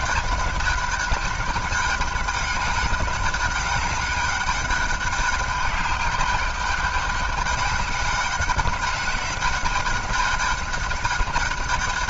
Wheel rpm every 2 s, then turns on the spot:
200, 200, 200, 200, 200, 210.
none